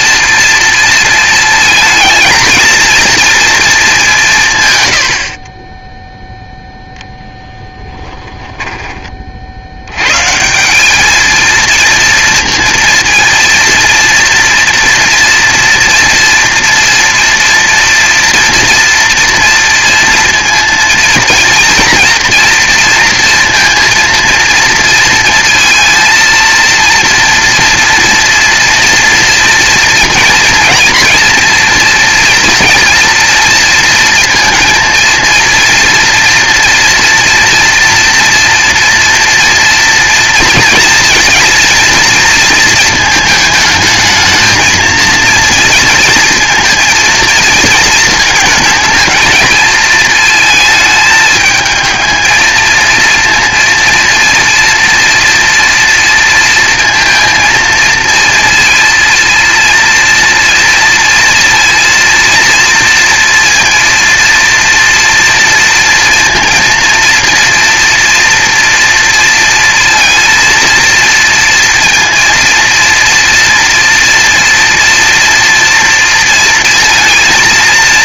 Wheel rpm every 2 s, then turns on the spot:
220, 200, 0, 10, 80, 230, 230, 230, 240, 230, 230, 230, 230, 230, 230, 230, 230, 230, 240, 230, 230, 220, 230, 220, 220, 220, 230, 230, 230, 230, 230, 230, 230, 230, 230, 230, 240, 230, 230.
6-8